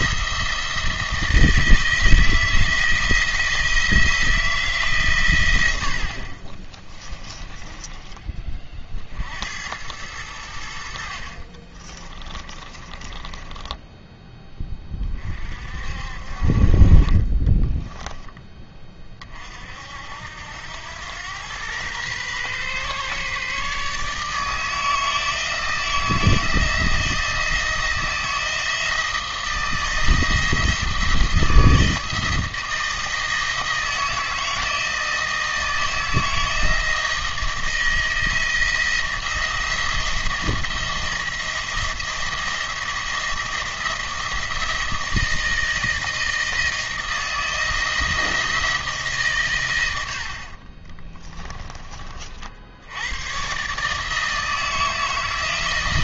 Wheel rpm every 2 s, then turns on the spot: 170, 160, 150, 30, 40, 70, 20, 20, 40, 20, 90, 130, 160, 160, 160, 160, 160, 160, 160, 170, 170, 170, 170, 160, 160, 30, 70, 160.
6-8 12-14